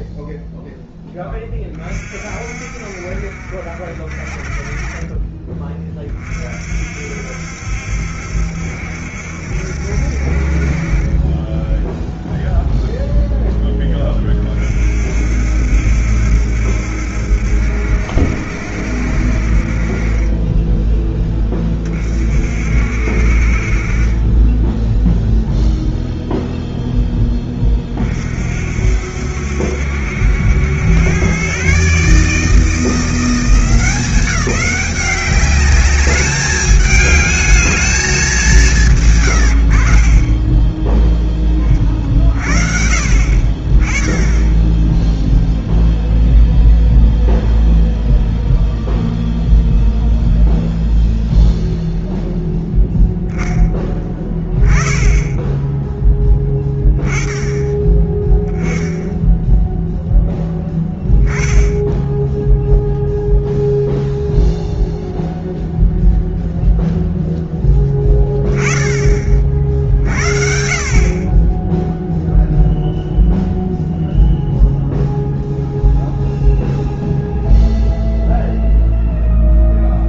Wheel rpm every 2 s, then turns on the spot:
0, 40, 30, 40, 70, 50, 0, 30, 70, 70, 20, 50, 20, 0, 50, 80, 150, 190, 210, 200, 20, 50, 10, 0, 0, 0, 0, 10, 10, 10, 0, 0, 0, 0, 10, 50, 0, 0, 0, 0.
none